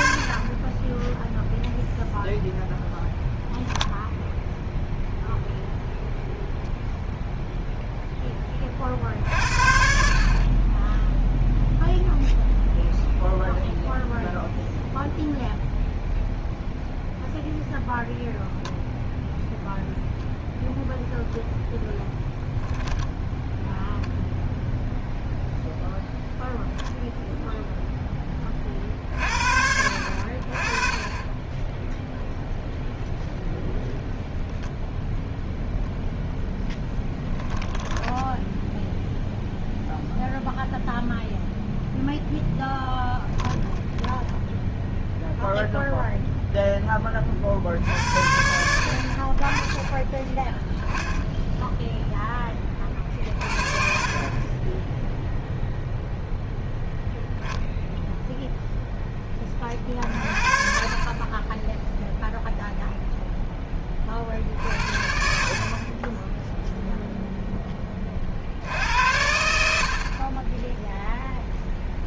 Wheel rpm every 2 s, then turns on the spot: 20, 0, 0, 0, 30, 20, 0, 0, 0, 0, 0, 10, 0, 0, 40, 30, 0, 0, 10, 0, 0, 10, 0, 10, 60, 0, 30, 10, 0, 0, 40, 0, 60, 0, 80, 10.
36-38 60-62